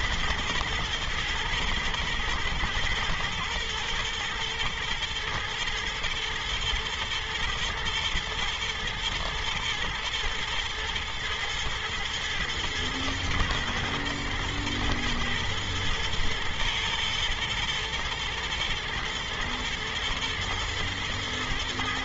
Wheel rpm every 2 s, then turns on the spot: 120, 120, 120, 110, 120, 110, 120, 120, 120, 110, 110.
none